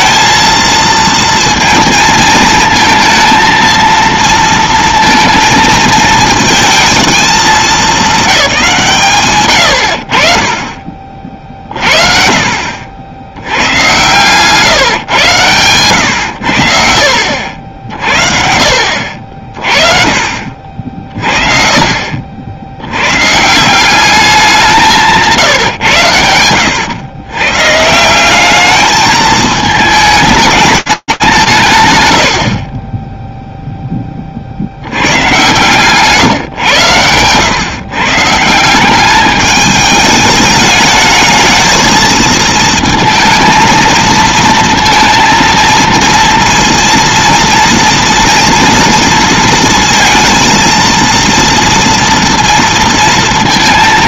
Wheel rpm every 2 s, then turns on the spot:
230, 220, 230, 220, 180, 30, 50, 140, 70, 60, 60, 80, 170, 100, 220, 200, 10, 90, 110, 190, 220, 230, 230, 230, 230, 230, 230.
12-14